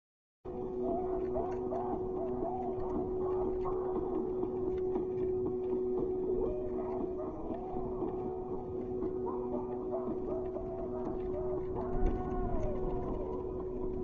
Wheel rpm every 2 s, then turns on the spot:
0, 0, 0, 0, 0, 0, 0.
none